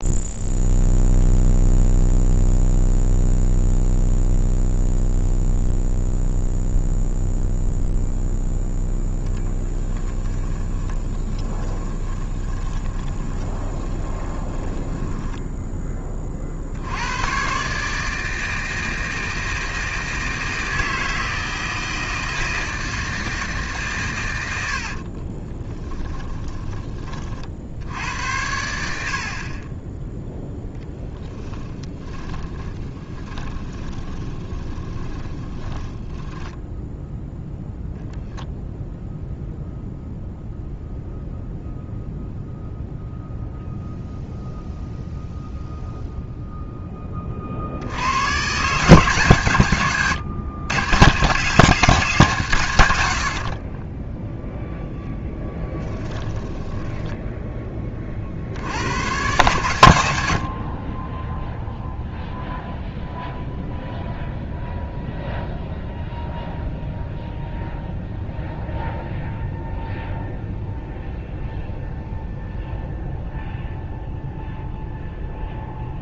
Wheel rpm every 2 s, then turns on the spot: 0, 0, 0, 0, 10, 20, 20, 10, 80, 160, 160, 160, 50, 30, 70, 0, 20, 20, 0, 0, 0, 0, 0, 20, 160, 150, 110, 0, 10, 100, 20, 0, 0, 0, 0, 0, 0, 0.
10-16 24-26 32-36 56-58